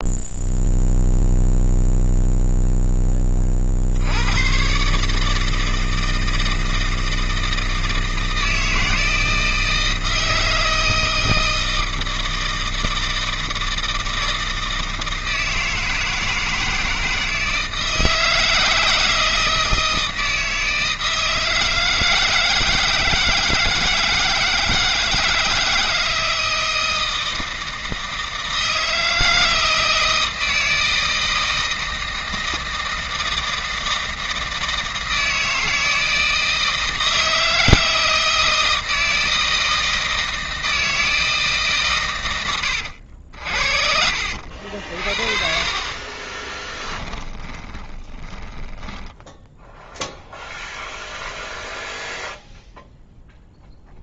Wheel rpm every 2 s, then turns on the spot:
0, 0, 140, 160, 160, 160, 160, 160, 160, 160, 160, 160, 160, 160, 160, 160, 160, 160, 160, 160, 160, 80, 60, 10, 10, 0, 0.
46-48